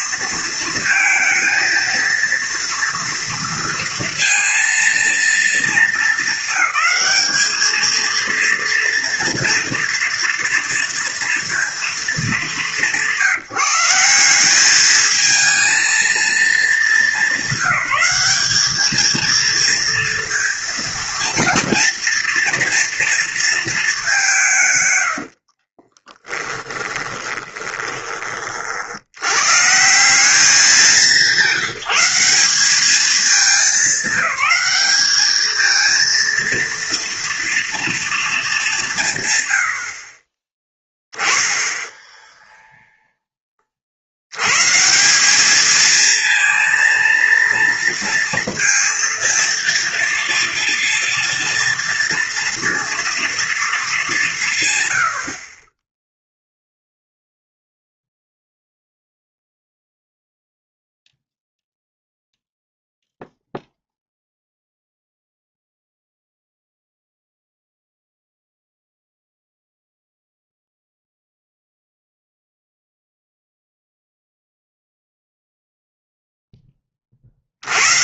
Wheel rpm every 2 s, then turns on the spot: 230, 230, 230, 200, 230, 230, 200, 190, 220, 210, 230, 230, 170, 20, 40, 190, 190, 210, 230, 210, 20, 0, 100, 230, 230, 230, 230, 150, 0, 0, 0, 0, 0, 0, 0, 0, 0, 0, 10.
26-28